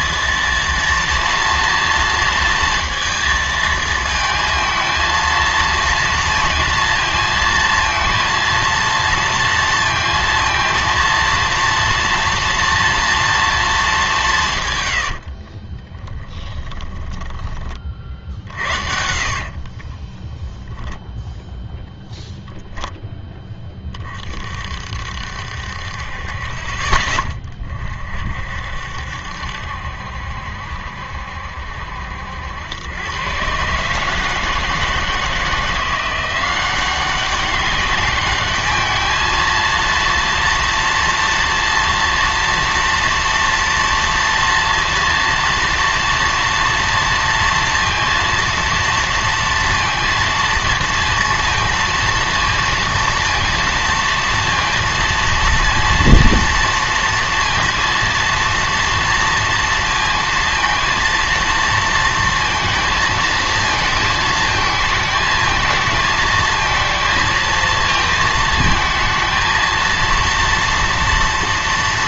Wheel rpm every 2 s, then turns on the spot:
230, 230, 220, 230, 230, 230, 230, 140, 10, 70, 10, 0, 50, 30, 60, 70, 90, 160, 190, 210, 230, 230, 230, 240, 230, 230, 230, 230, 230, 230, 230, 230, 220, 220, 220, 230.
16-22